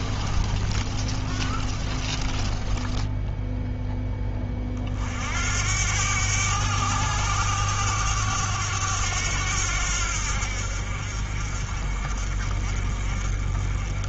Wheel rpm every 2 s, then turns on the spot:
30, 20, 30, 100, 100, 60, 40.
0-4